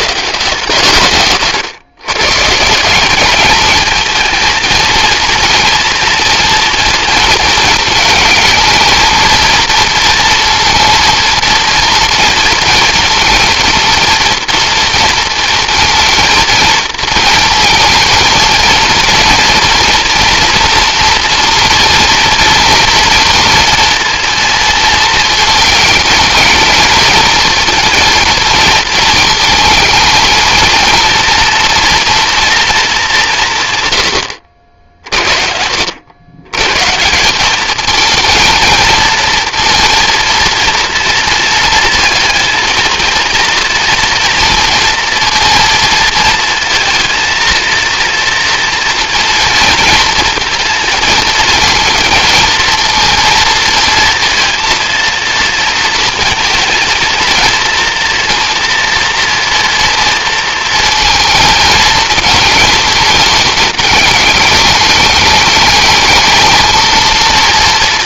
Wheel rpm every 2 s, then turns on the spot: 160, 170, 230, 230, 220, 230, 230, 230, 220, 230, 230, 230, 230, 220, 230, 230, 230, 70, 110, 220, 230, 230, 230, 230, 230, 230, 230, 230, 220, 230, 230, 220, 210, 220.
none